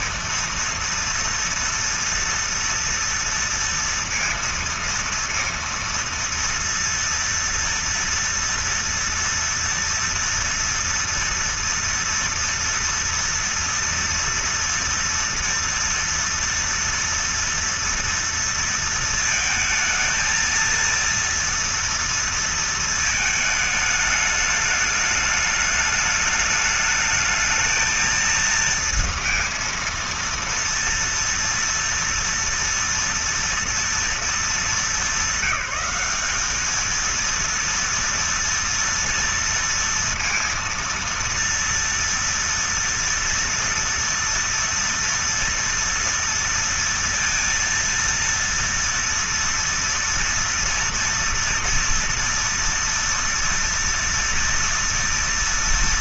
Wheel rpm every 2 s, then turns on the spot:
230, 230, 230, 230, 230, 230, 230, 230, 230, 230, 230, 220, 210, 210, 230, 230, 230, 200, 220, 230, 230, 230, 230, 230, 230, 230, 230, 230.
none